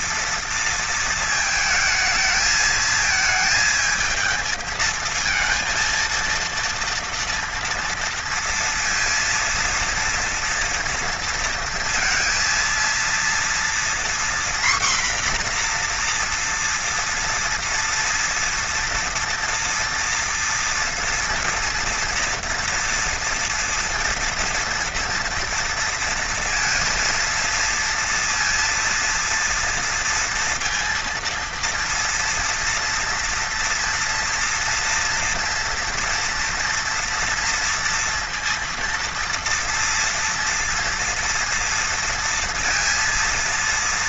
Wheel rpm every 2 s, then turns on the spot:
220, 220, 230, 230, 230, 230, 230, 250, 230, 230, 230, 230, 230, 230, 230, 230, 230, 230, 230, 230, 230, 230.
none